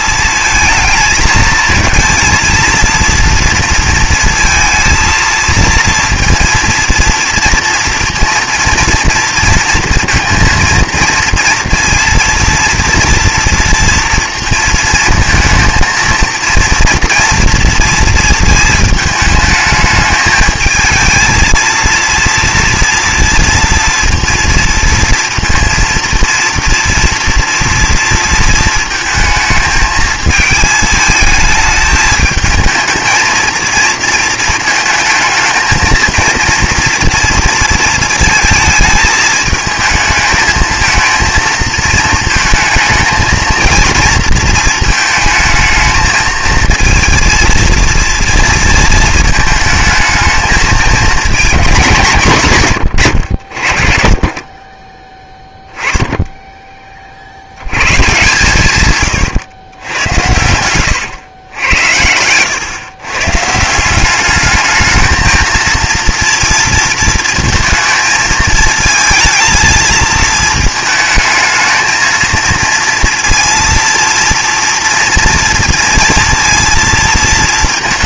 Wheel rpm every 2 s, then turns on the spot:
220, 230, 230, 230, 230, 230, 230, 220, 230, 220, 220, 230, 230, 230, 220, 220, 220, 220, 230, 220, 220, 220, 230, 230, 230, 220, 130, 20, 20, 130, 100, 120, 210, 230, 220, 220, 230, 240, 230.
none